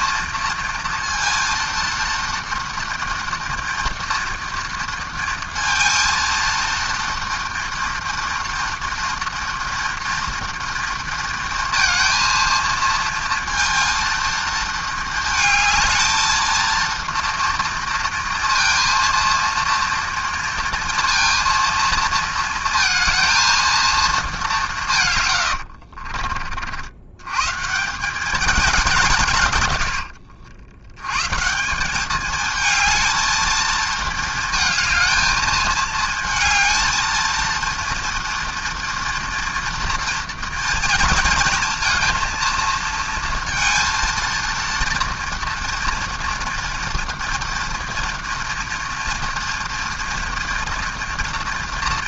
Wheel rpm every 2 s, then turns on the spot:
230, 230, 230, 230, 230, 230, 230, 220, 230, 230, 230, 230, 160, 90, 170, 90, 230, 220, 230, 230, 230, 230, 230, 240, 230, 240.
none